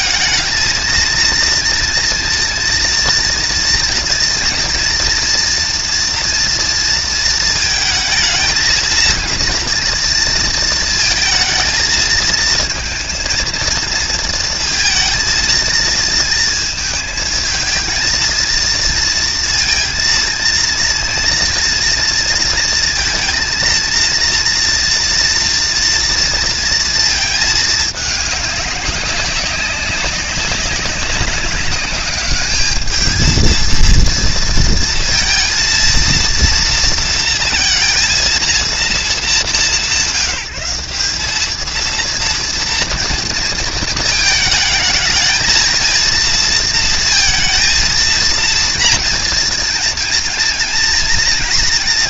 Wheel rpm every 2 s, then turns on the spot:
230, 230, 230, 230, 230, 230, 230, 230, 220, 230, 230, 230, 240, 230, 200, 200, 220, 230, 230, 220, 180, 240, 220, 230, 230, 230.
none